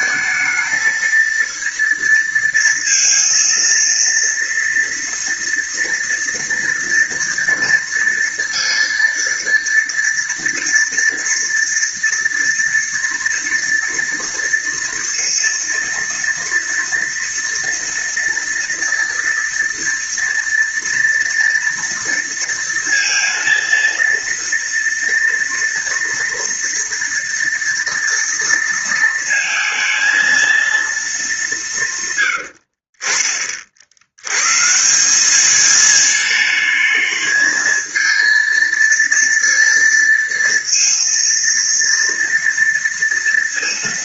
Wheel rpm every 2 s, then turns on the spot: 220, 230, 230, 230, 230, 230, 230, 230, 230, 230, 230, 230, 230, 230, 230, 220, 60, 160, 220, 230, 230, 230.
none